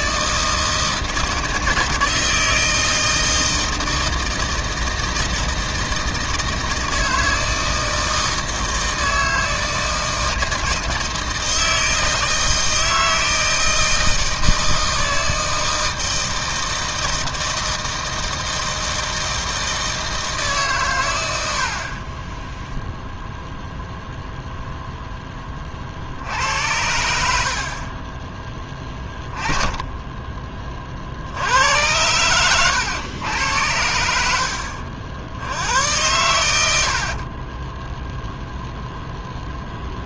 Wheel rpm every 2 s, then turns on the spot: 160, 160, 160, 160, 160, 160, 160, 160, 160, 160, 140, 10, 0, 80, 20, 40, 100, 70, 80, 0.
none